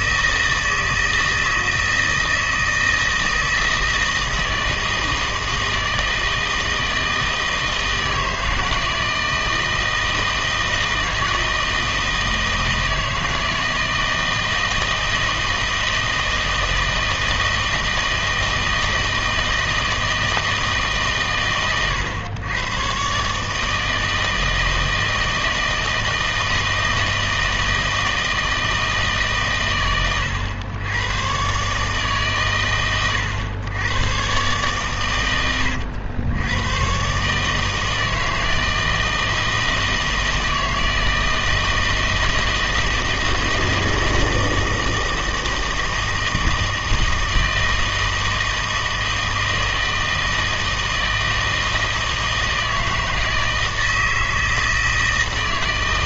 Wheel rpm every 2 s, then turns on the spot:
160, 160, 160, 160, 160, 160, 160, 160, 160, 160, 160, 110, 160, 160, 160, 90, 120, 130, 110, 160, 160, 160, 160, 160, 160, 160, 160, 160.
none